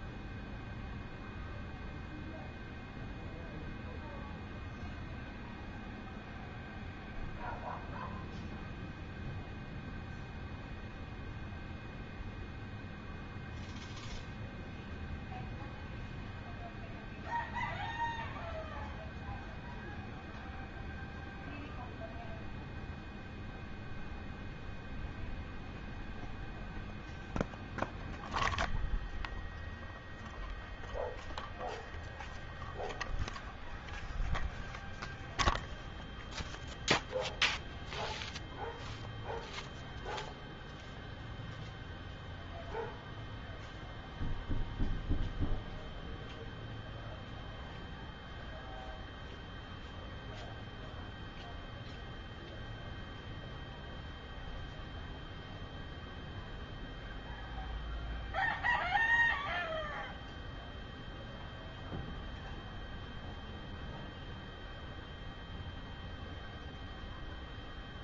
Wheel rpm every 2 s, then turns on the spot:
0, 0, 0, 0, 0, 0, 0, 0, 0, 0, 0, 0, 0, 0, 0, 0, 0, 0, 0, 0, 0, 0, 0, 0, 0, 0, 0, 0, 0, 0, 0, 0, 0, 0.
none